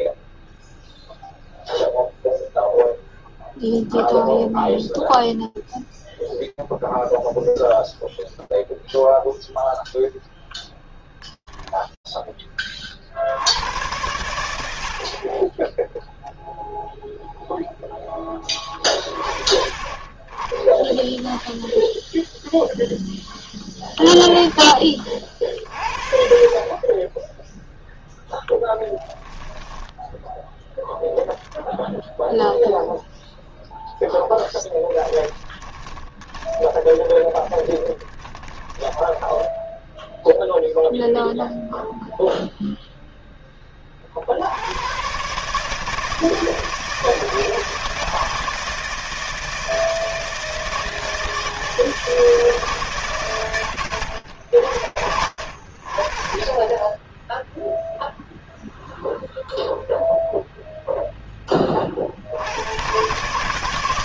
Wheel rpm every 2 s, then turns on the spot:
0, 0, 0, 0, 0, 20, 60, 0, 20, 30, 0, 10, 50, 0, 10, 0, 0, 10, 10, 10, 0, 10, 130, 160, 170, 160, 130, 80, 10, 0, 0, 90.
28-30 34-40